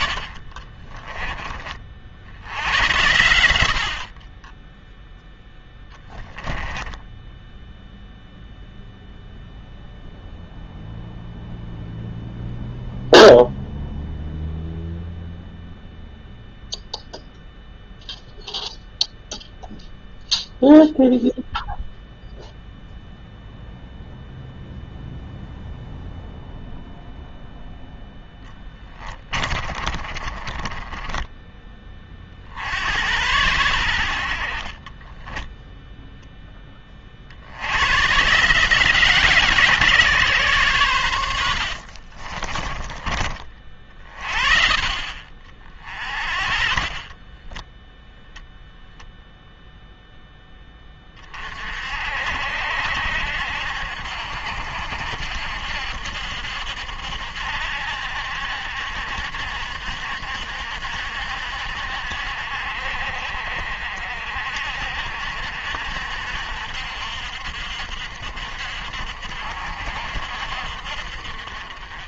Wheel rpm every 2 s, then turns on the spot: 30, 80, 0, 10, 0, 0, 0, 0, 0, 0, 0, 0, 0, 0, 10, 20, 70, 30, 20, 160, 120, 20, 40, 40, 0, 20, 70, 70, 70, 70, 70, 60, 60, 60, 60, 60.
0-2 6-8 28-32 34-36 42-44 46-48